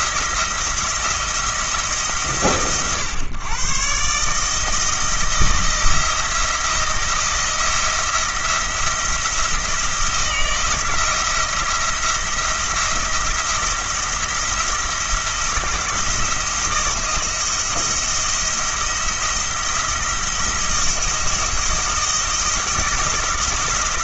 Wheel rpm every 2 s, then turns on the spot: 160, 130, 160, 170, 170, 170, 170, 170, 160, 170, 170, 170.
none